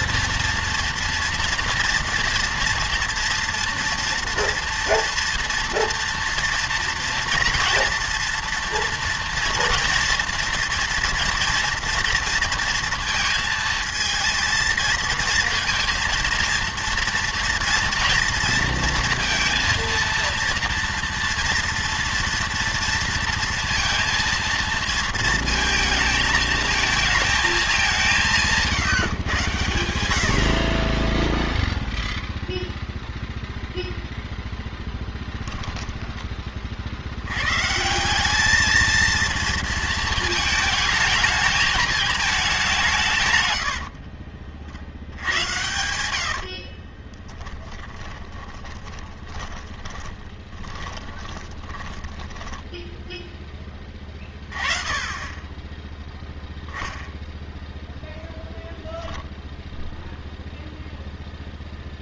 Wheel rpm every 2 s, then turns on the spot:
230, 230, 230, 230, 240, 240, 230, 230, 230, 230, 230, 230, 230, 220, 160, 40, 0, 10, 40, 220, 220, 190, 60, 40, 40, 20, 10, 20, 0, 0, 0.
28-30 34-36 46-54